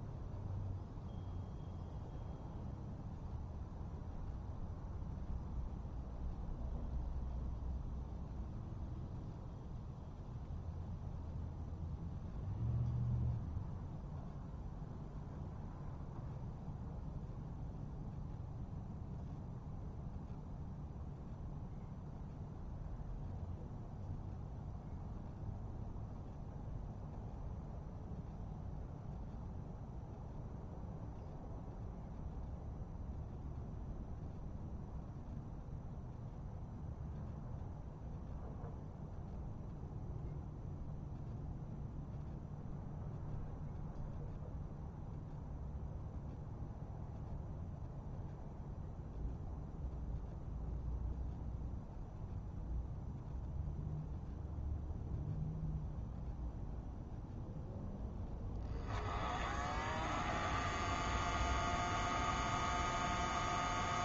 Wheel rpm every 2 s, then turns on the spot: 0, 0, 0, 0, 0, 0, 0, 0, 0, 0, 0, 0, 0, 0, 0, 0, 0, 0, 0, 0, 0, 0, 0, 0, 0, 0, 0, 0, 0, 0, 0, 0.
none